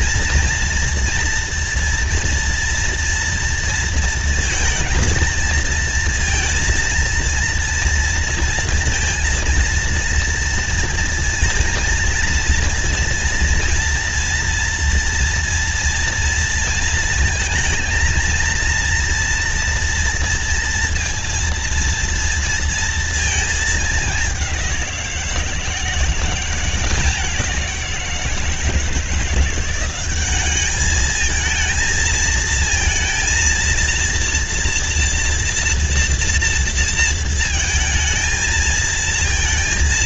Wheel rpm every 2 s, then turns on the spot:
240, 240, 230, 230, 230, 230, 230, 240, 230, 230, 230, 230, 190, 180, 170, 200, 230, 230, 230, 230.
none